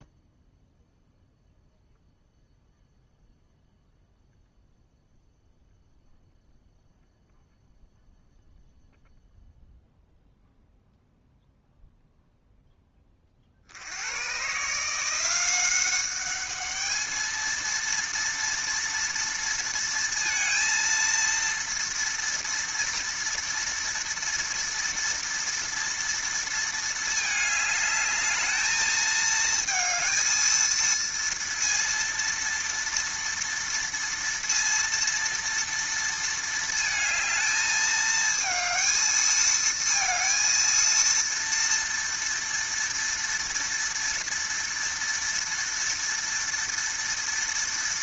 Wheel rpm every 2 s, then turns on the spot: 0, 0, 0, 0, 0, 0, 10, 150, 210, 230, 230, 230, 230, 220, 220, 230, 230, 230, 220, 220, 230, 230, 230, 230.
none